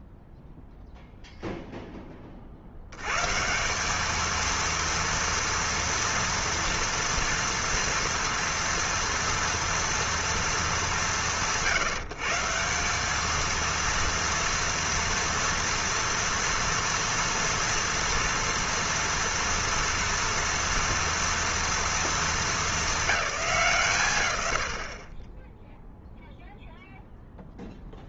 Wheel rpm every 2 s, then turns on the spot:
0, 60, 230, 230, 230, 190, 180, 240, 230, 230, 230, 220, 110, 0.
none